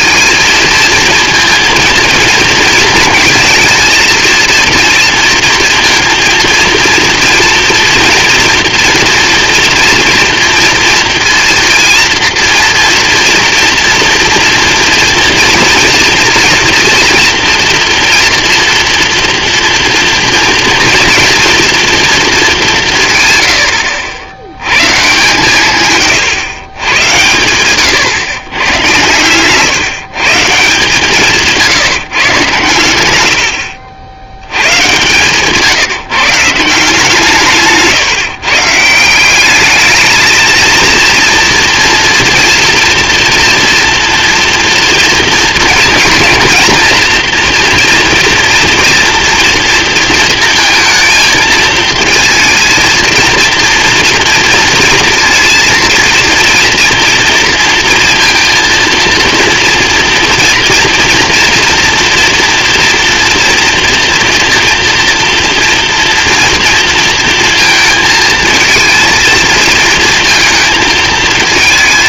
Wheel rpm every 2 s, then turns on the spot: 230, 230, 230, 230, 230, 230, 240, 230, 230, 230, 230, 190, 110, 110, 110, 150, 110, 110, 160, 150, 230, 240, 230, 230, 240, 230, 230, 230, 230, 230, 240, 230, 230, 230, 230, 220.
none